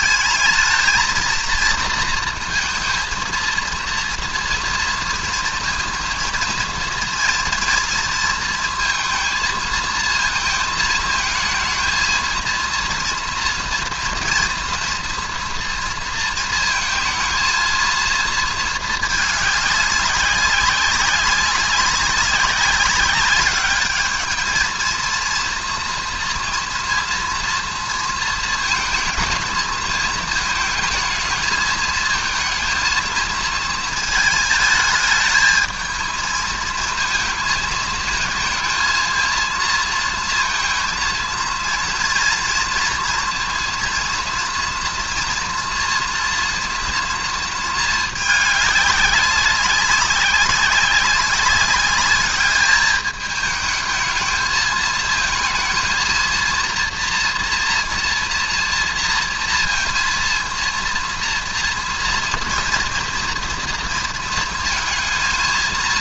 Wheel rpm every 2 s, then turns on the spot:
220, 230, 230, 230, 230, 220, 230, 230, 220, 220, 200, 200, 220, 230, 230, 220, 230, 220, 220, 230, 230, 230, 240, 230, 200, 190, 210, 220, 230, 230, 230, 230, 230.
none